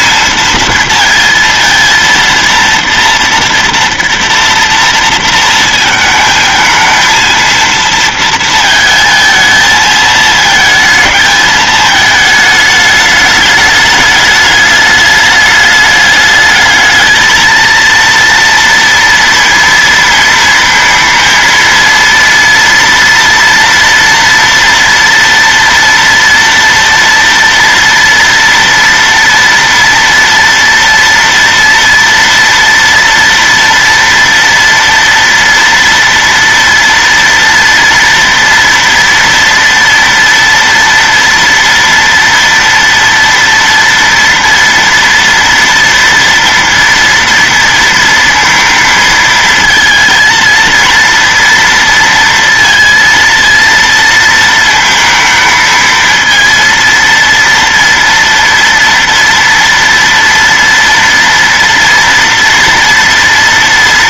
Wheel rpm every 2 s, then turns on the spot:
230, 230, 230, 220, 230, 220, 220, 210, 210, 230, 230, 230, 230, 230, 230, 230, 230, 230, 230, 230, 230, 230, 230, 230, 230, 220, 230, 230, 230, 230, 230, 230.
none